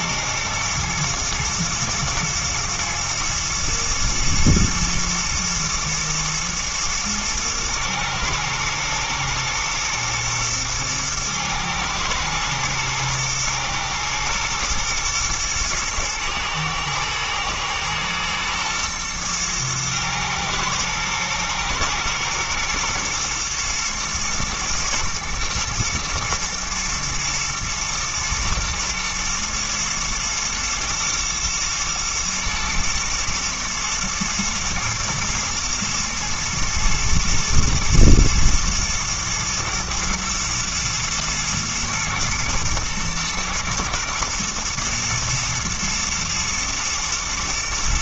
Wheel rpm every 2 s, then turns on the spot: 120, 110, 120, 110, 110, 110, 110, 110, 110, 110, 110, 120, 110, 110, 110, 120, 110, 110, 110, 120, 110, 120, 120, 110.
none